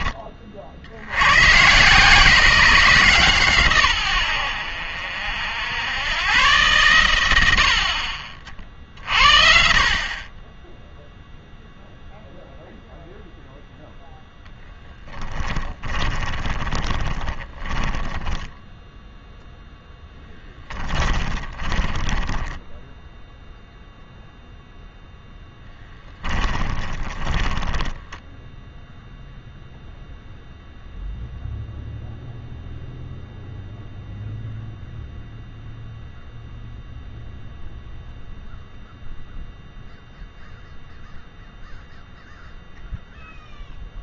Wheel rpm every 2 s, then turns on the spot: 60, 160, 70, 110, 60, 10, 0, 20, 20, 10, 20, 10, 0, 20, 0, 0, 0, 0, 0, 0, 0, 0.
14-18 20-24 26-28